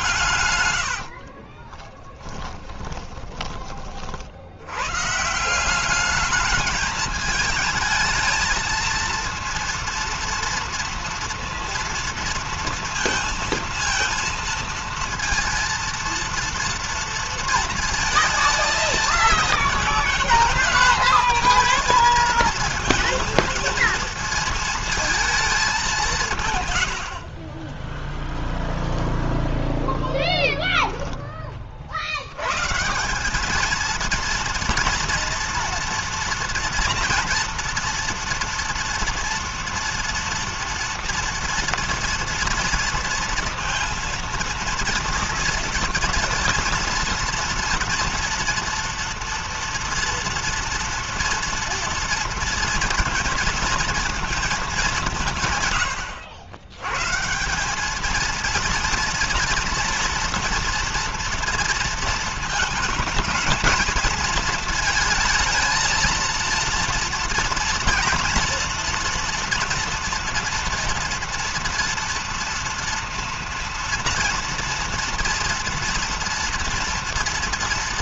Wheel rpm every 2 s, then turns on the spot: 120, 10, 70, 210, 220, 230, 230, 230, 230, 220, 210, 220, 230, 150, 10, 0, 110, 230, 230, 230, 240, 230, 230, 230, 230, 230, 230, 220, 90, 220, 230, 230, 220, 230, 230, 230, 230, 230, 230.
0-4